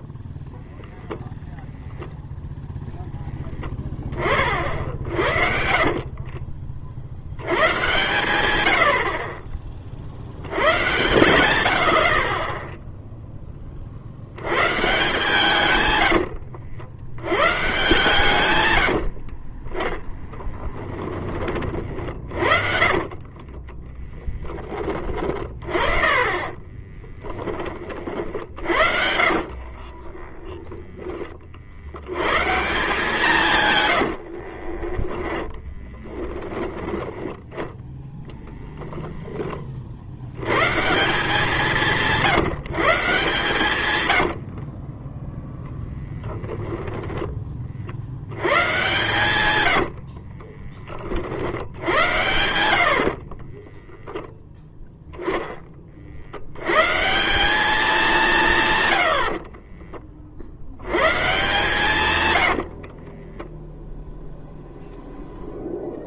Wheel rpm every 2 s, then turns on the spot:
0, 0, 30, 40, 100, 80, 20, 100, 80, 120, 10, 40, 10, 20, 60, 20, 130, 50, 10, 0, 110, 150, 60, 20, 110, 30, 80, 0, 80, 160, 60, 100, 0.
6-8 16-24 26-32 34-36 44-48 50-52 62-64